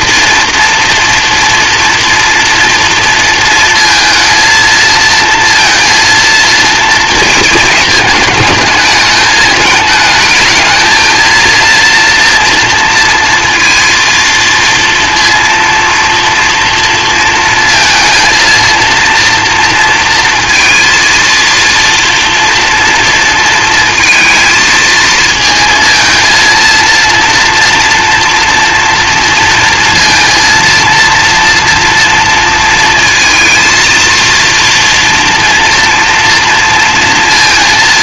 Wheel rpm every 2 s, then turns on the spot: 230, 230, 230, 230, 220, 220, 230, 230, 230, 230, 230, 240, 220, 230, 230, 230, 230, 230, 230.
none